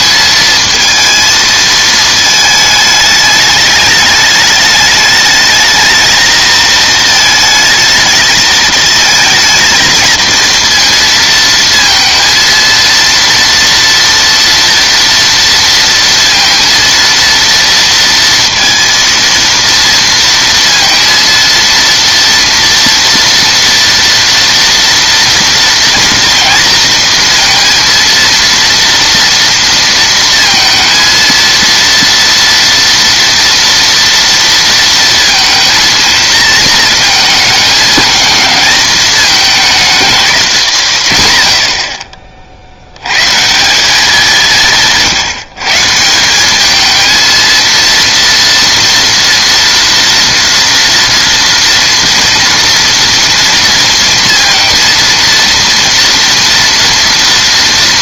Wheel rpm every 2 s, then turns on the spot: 230, 220, 210, 220, 220, 230, 230, 230, 230, 230, 230, 230, 230, 230, 230, 230, 230, 230, 220, 210, 170, 60, 180, 200, 230, 230, 230, 230, 230.
none